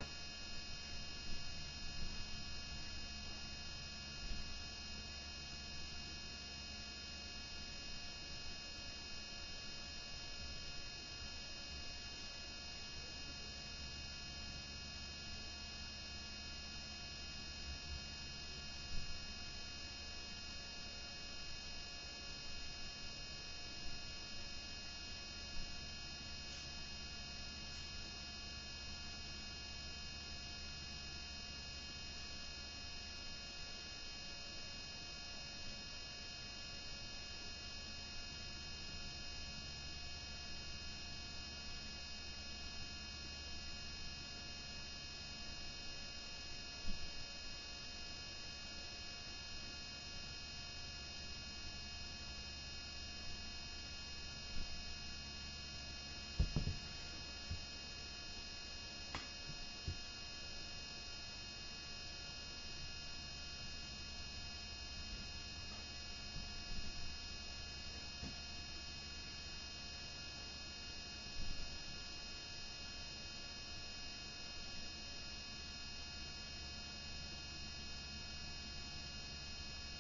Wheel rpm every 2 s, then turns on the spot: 0, 0, 0, 0, 0, 0, 0, 0, 0, 0, 0, 0, 0, 0, 0, 0, 0, 0, 0, 0, 0, 0, 0, 0, 0, 0, 0, 0, 0, 0, 0, 0, 0, 0, 0, 0, 0, 0, 0, 0.
none